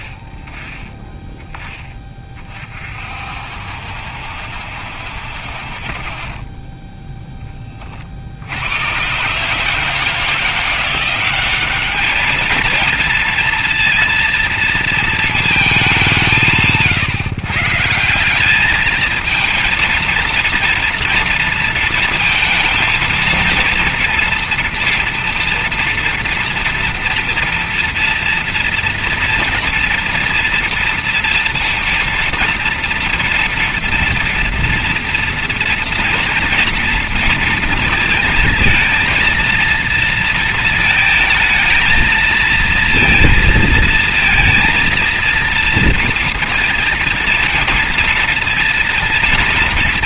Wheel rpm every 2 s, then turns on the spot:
20, 40, 70, 20, 80, 170, 220, 230, 160, 210, 230, 230, 230, 230, 230, 230, 230, 230, 230, 230, 230, 230, 230, 230, 230.
none